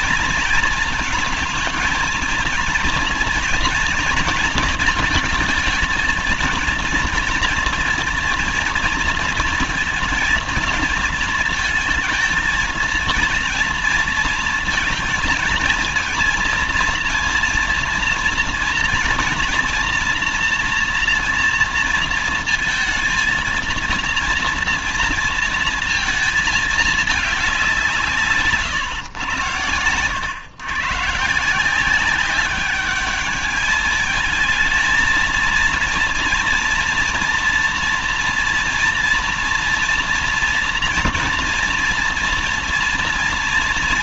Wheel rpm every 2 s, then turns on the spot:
230, 230, 230, 230, 230, 230, 230, 230, 230, 230, 230, 230, 230, 220, 140, 130, 200, 220, 230, 230, 230, 230.
none